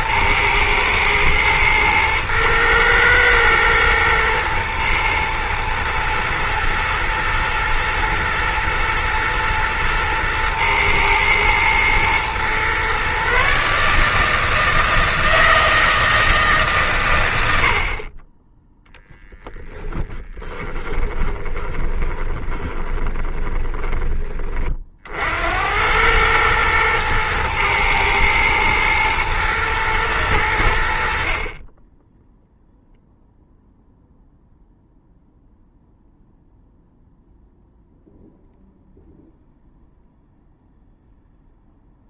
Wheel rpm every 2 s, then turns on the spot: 120, 110, 110, 110, 120, 110, 130, 160, 130, 0, 20, 20, 60, 110, 110, 60, 0, 0, 0, 0, 0.
20-24